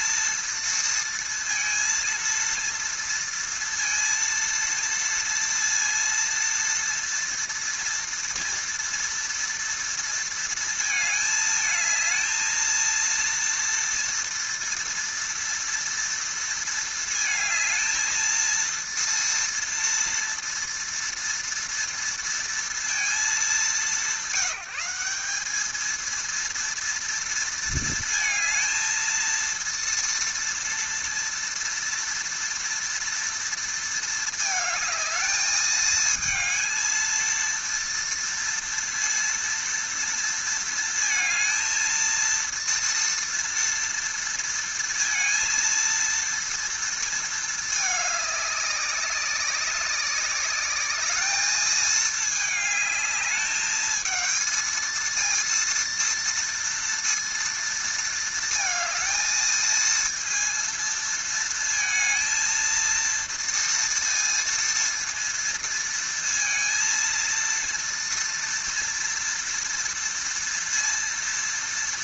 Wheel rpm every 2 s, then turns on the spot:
230, 230, 230, 230, 230, 230, 230, 230, 230, 230, 230, 230, 180, 230, 230, 230, 230, 220, 220, 230, 230, 230, 230, 230, 200, 200, 210, 220, 230, 230, 230, 230, 230, 230, 230, 230.
none